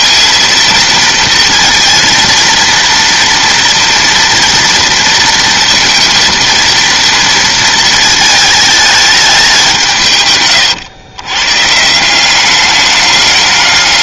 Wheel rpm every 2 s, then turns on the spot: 230, 230, 230, 230, 220, 120, 200.
none